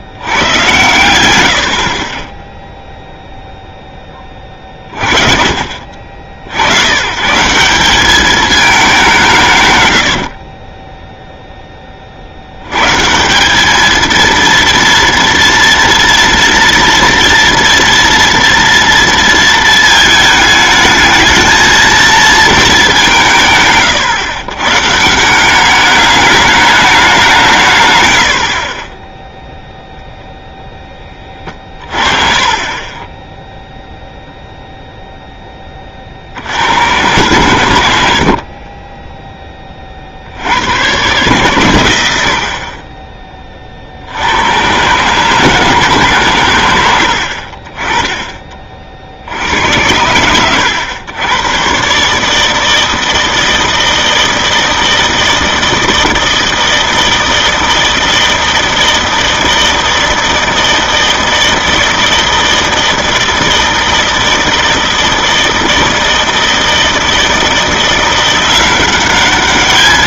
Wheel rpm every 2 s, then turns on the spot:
110, 0, 30, 80, 210, 30, 110, 230, 230, 230, 210, 220, 130, 200, 30, 0, 30, 0, 90, 30, 100, 50, 110, 100, 30, 100, 160, 160, 160, 160, 160, 160, 160, 160, 180.
10-12 32-34 38-40